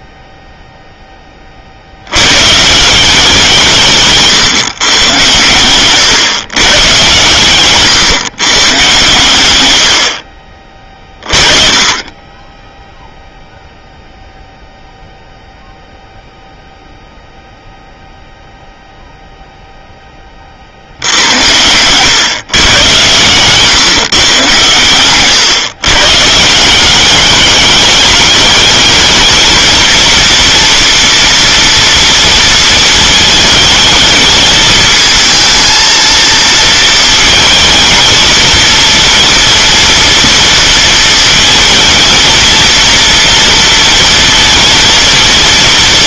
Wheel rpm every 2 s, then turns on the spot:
0, 150, 130, 120, 120, 40, 10, 0, 0, 0, 50, 120, 120, 160, 210, 230, 220, 220, 220, 230, 230, 230, 230.
10-14